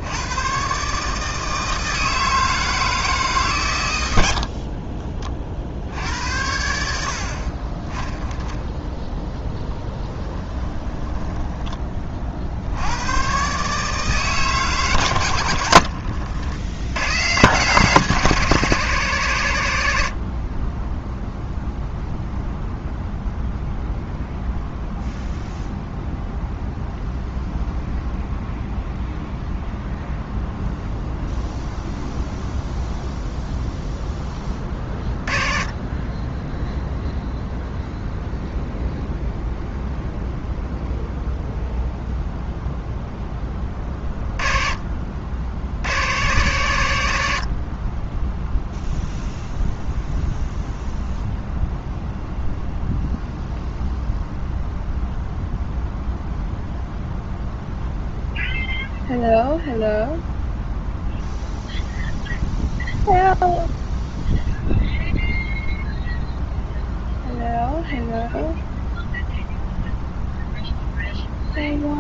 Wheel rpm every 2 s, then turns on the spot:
140, 160, 40, 70, 10, 10, 80, 130, 100, 140, 20, 0, 0, 0, 0, 0, 0, 20, 0, 0, 0, 0, 30, 110, 0, 0, 0, 0, 0, 0, 0, 0, 0, 0, 0, 0.
4-6 10-12